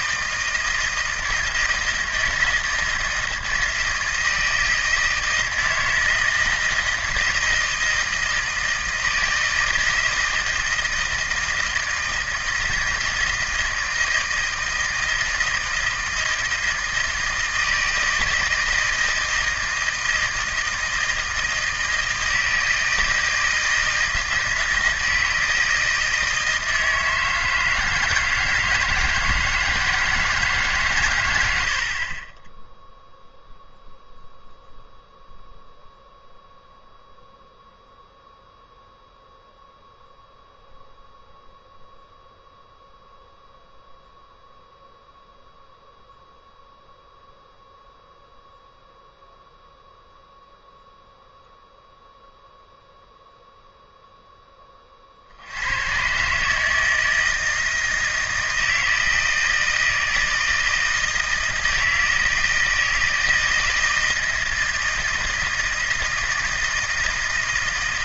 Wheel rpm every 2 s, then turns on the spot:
160, 160, 160, 160, 160, 160, 160, 160, 160, 160, 160, 160, 170, 160, 160, 140, 0, 0, 0, 0, 0, 0, 0, 0, 0, 0, 0, 20, 150, 160, 160, 160, 160, 160.
none